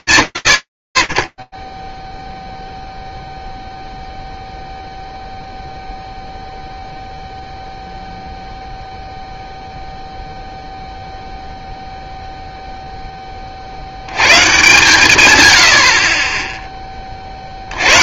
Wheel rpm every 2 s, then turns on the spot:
160, 0, 0, 0, 0, 0, 10, 130, 30.
none